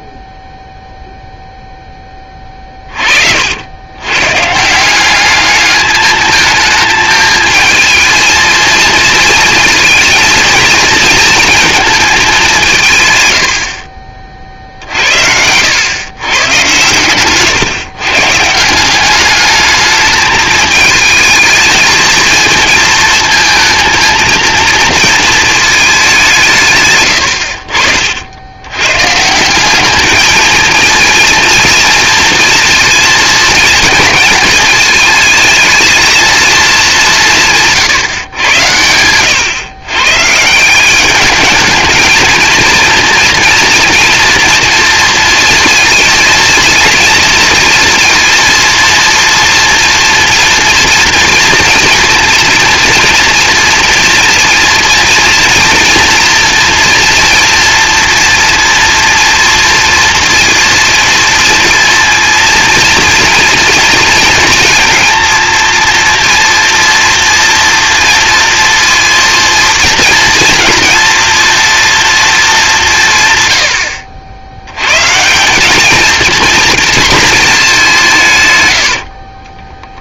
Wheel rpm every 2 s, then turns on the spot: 0, 20, 150, 220, 220, 220, 180, 50, 120, 170, 210, 230, 230, 160, 100, 220, 230, 220, 220, 110, 170, 230, 230, 230, 230, 230, 230, 230, 230, 240, 230, 230, 230, 230, 230, 230, 200, 100, 230, 110.
14-16